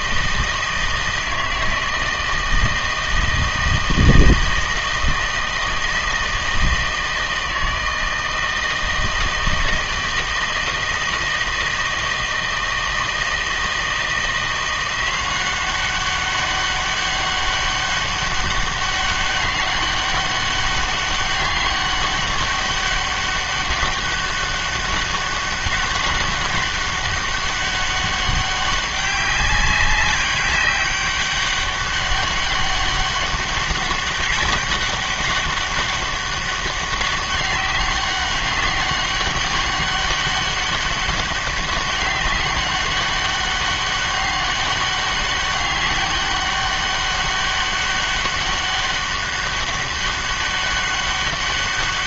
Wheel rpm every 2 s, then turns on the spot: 160, 160, 160, 160, 160, 160, 160, 170, 200, 200, 200, 200, 200, 200, 200, 200, 200, 200, 200, 200, 200, 200, 200, 200, 200, 200.
none